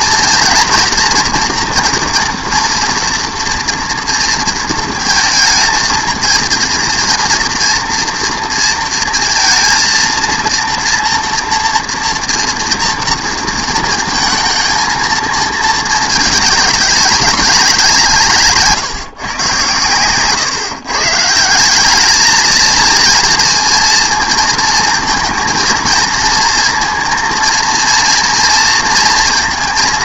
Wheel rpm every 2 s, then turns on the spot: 240, 230, 220, 230, 230, 230, 230, 230, 210, 150, 130, 220, 220, 230, 230.
none